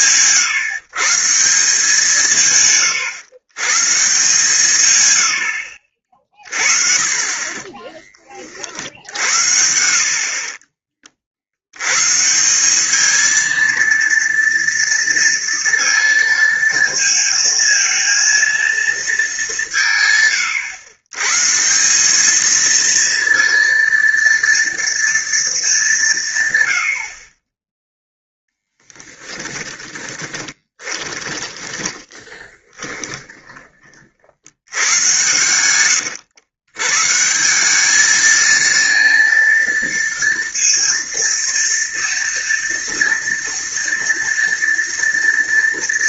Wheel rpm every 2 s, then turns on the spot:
140, 140, 130, 30, 50, 30, 190, 230, 230, 230, 110, 230, 230, 100, 10, 30, 20, 100, 120, 230, 230, 230, 230.
28-34